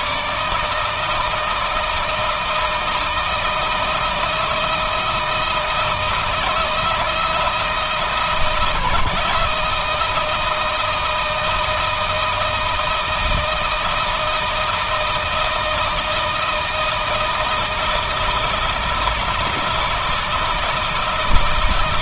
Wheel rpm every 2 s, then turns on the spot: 150, 160, 160, 160, 160, 160, 160, 160, 160, 160, 160.
none